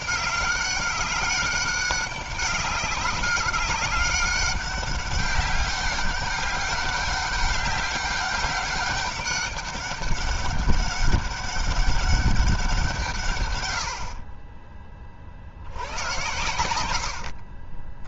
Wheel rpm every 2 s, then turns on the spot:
190, 190, 200, 190, 200, 200, 170, 30, 100.
16-18